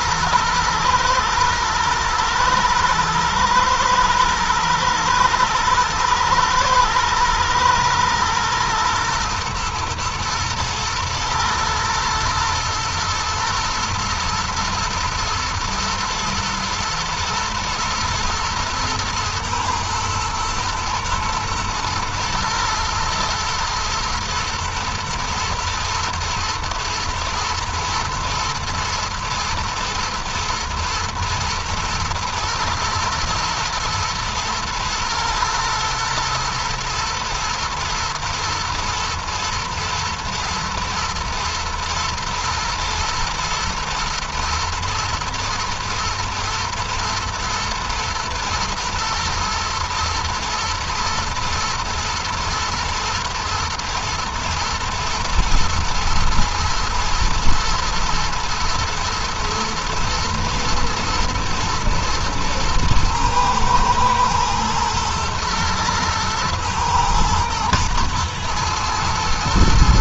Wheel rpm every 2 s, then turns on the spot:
110, 110, 110, 110, 110, 110, 120, 120, 120, 110, 120, 120, 110, 120, 110, 120, 110, 110, 110, 110, 110, 110, 110, 120, 110, 110, 120, 120, 110, 120, 110, 110, 120, 110, 110.
none